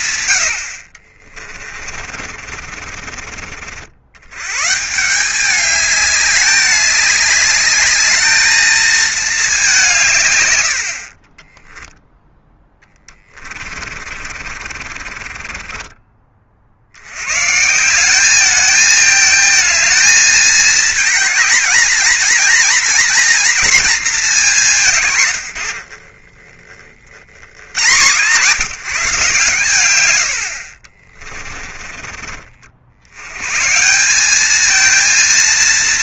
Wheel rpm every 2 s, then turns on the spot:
100, 40, 160, 200, 220, 60, 10, 40, 70, 220, 220, 240, 180, 40, 180, 60, 70, 230.
2-4 12-16 30-32